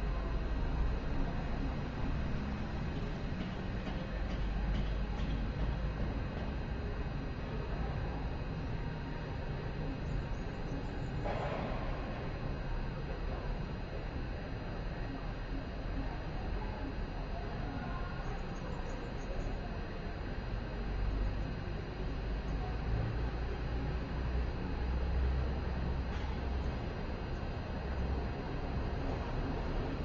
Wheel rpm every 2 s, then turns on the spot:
0, 0, 0, 0, 0, 0, 0, 0, 0, 0, 0, 0, 0, 0, 0.
none